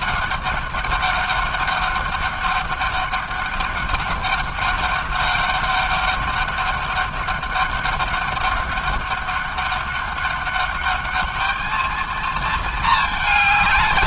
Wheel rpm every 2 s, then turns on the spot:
200, 200, 200, 200, 200, 200, 220.
none